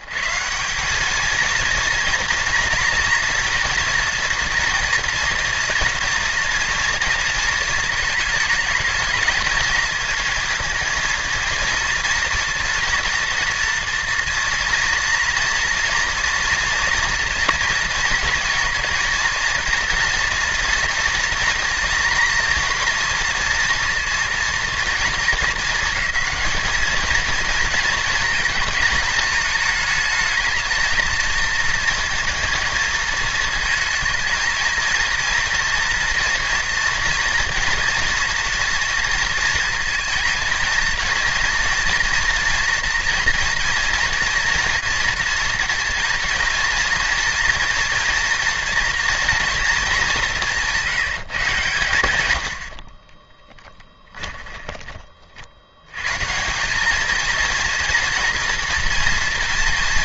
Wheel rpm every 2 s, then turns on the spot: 170, 230, 230, 230, 220, 220, 230, 230, 230, 230, 230, 230, 230, 220, 220, 220, 230, 220, 240, 230, 230, 230, 230, 230, 230, 180, 80, 20, 190, 240.
54-56